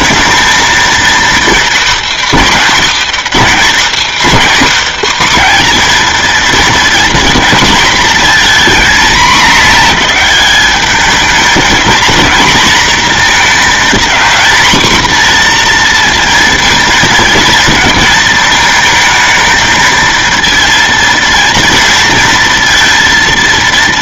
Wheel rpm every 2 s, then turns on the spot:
230, 260, 270, 230, 240, 210, 230, 230, 230, 220, 230, 230.
none